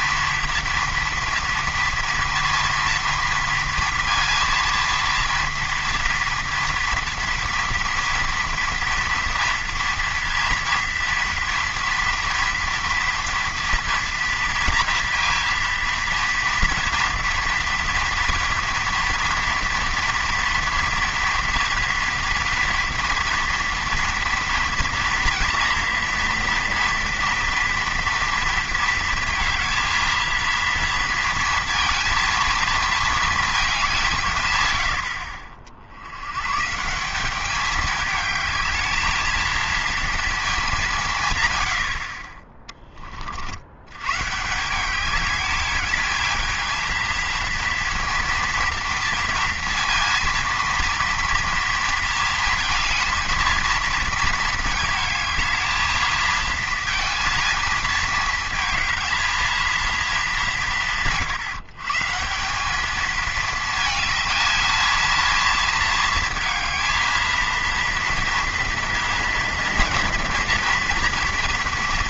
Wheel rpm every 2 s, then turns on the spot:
230, 230, 230, 230, 230, 230, 230, 230, 230, 230, 230, 230, 230, 230, 230, 230, 230, 110, 150, 220, 200, 20, 180, 220, 230, 230, 220, 220, 230, 220, 180, 200, 220, 220, 230, 240.
none